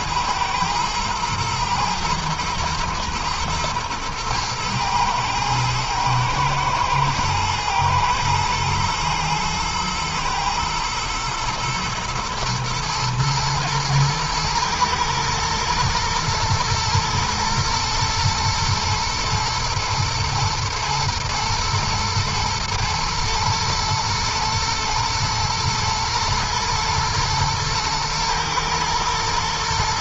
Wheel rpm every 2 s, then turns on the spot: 110, 120, 110, 120, 120, 110, 110, 120, 120, 110, 110, 110, 120, 110, 110.
none